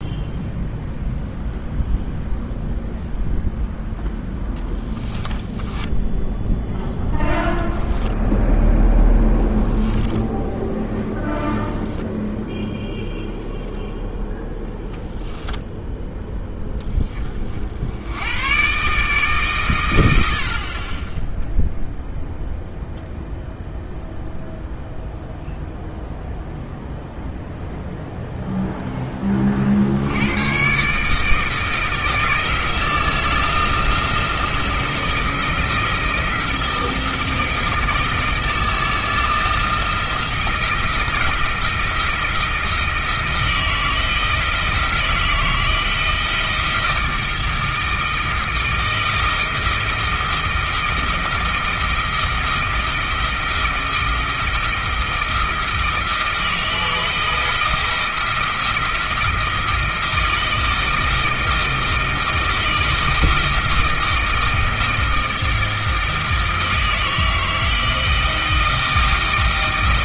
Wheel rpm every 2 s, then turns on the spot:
0, 0, 20, 0, 10, 0, 0, 0, 10, 140, 20, 0, 0, 0, 10, 140, 160, 160, 160, 160, 170, 160, 160, 160, 160, 160, 160, 170, 160, 160, 160, 160, 160, 160, 160.
4-6 8-10